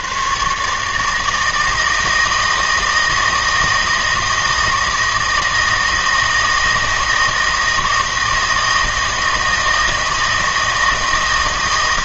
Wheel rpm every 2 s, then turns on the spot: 150, 160, 160, 160, 160, 160.
none